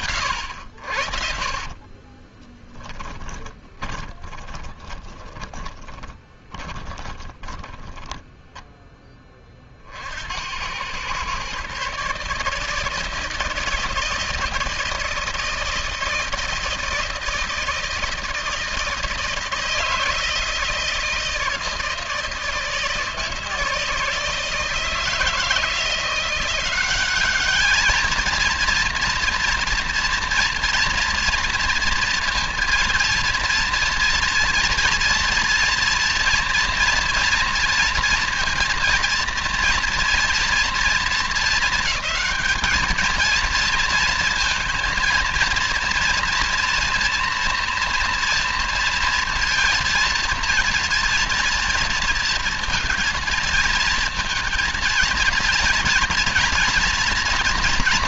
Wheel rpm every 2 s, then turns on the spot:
70, 20, 20, 20, 10, 90, 160, 170, 160, 160, 160, 160, 160, 190, 230, 230, 230, 230, 230, 230, 230, 220, 230, 230, 230, 230, 230, 230, 230.
2-8